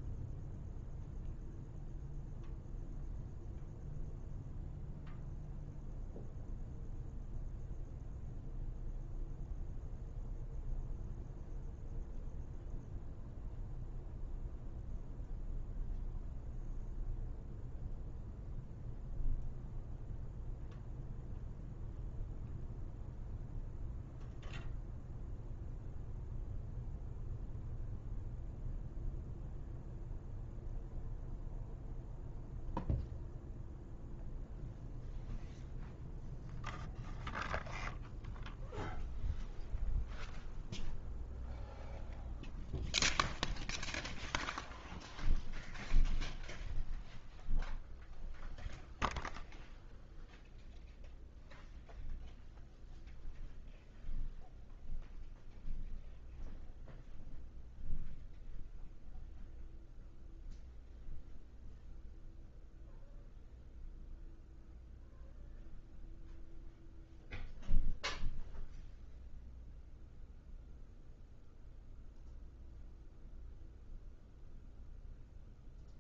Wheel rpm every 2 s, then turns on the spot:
0, 0, 0, 0, 0, 0, 0, 0, 0, 0, 0, 0, 0, 0, 0, 0, 0, 0, 0, 0, 0, 0, 0, 0, 0, 0, 0, 0, 0, 0, 0, 0, 0, 0, 0, 0, 0, 0.
none